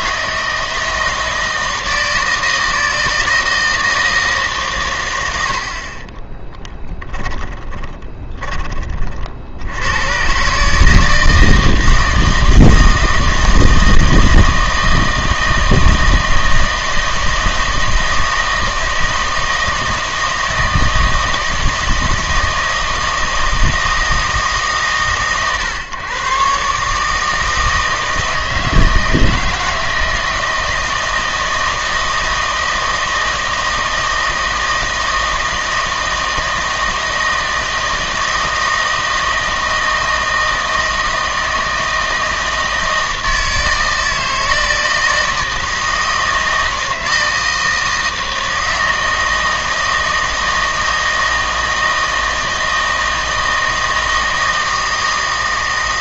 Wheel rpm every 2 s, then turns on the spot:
160, 160, 130, 10, 30, 150, 160, 160, 160, 160, 160, 160, 140, 140, 160, 160, 160, 160, 160, 160, 160, 160, 160, 160, 160, 160, 160, 160.
6-8